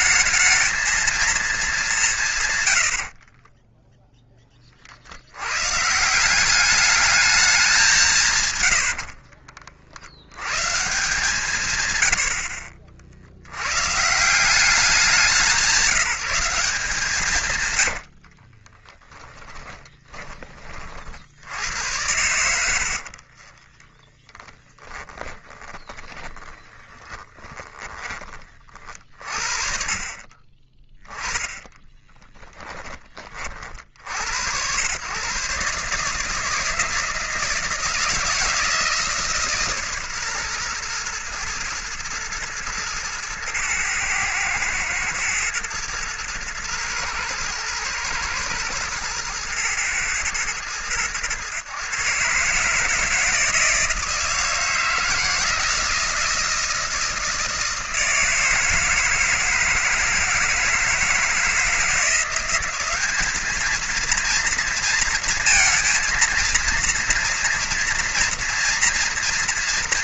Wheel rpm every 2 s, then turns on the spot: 220, 70, 50, 200, 80, 130, 60, 190, 170, 30, 40, 70, 10, 20, 40, 20, 20, 110, 160, 160, 120, 110, 110, 110, 110, 110, 150, 160, 160, 160, 160, 190, 230, 230, 230.
8-10 18-20 22-28